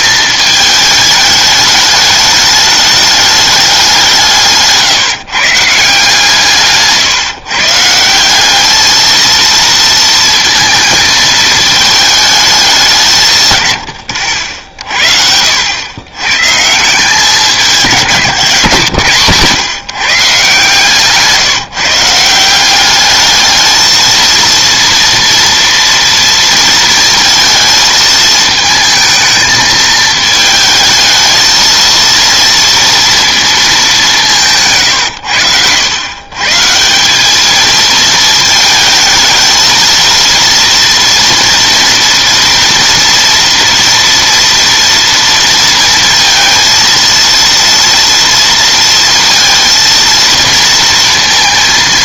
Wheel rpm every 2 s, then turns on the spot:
220, 210, 160, 150, 200, 230, 200, 60, 140, 140, 150, 180, 230, 230, 220, 220, 230, 150, 140, 220, 230, 230, 230, 230, 230, 230.
none